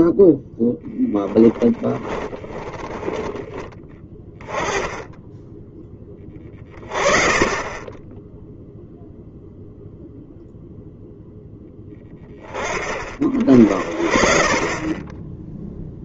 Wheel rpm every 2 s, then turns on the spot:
10, 20, 10, 20, 0, 0, 30, 20.
2-4